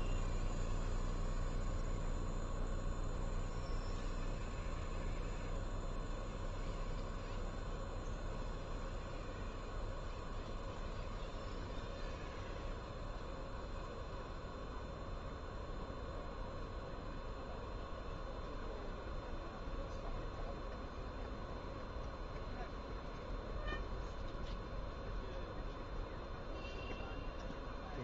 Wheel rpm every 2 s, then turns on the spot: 0, 0, 0, 0, 0, 0, 0, 0, 0, 0, 0, 0, 0, 0.
none